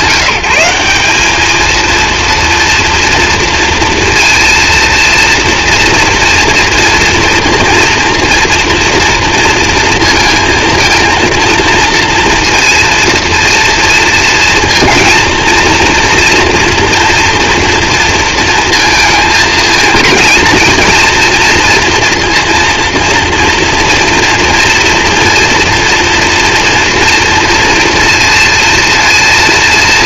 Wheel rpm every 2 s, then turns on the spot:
180, 230, 230, 230, 230, 220, 230, 230, 230, 230, 230, 230, 230, 230, 230.
none